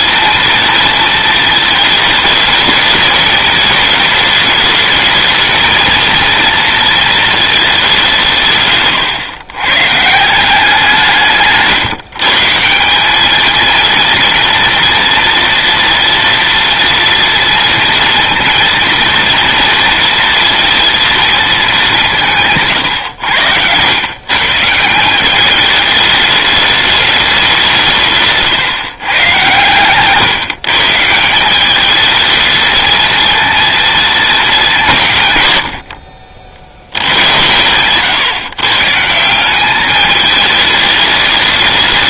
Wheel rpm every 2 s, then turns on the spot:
230, 210, 220, 230, 140, 170, 180, 230, 230, 230, 230, 140, 170, 210, 130, 160, 220, 170, 70, 150, 210.
none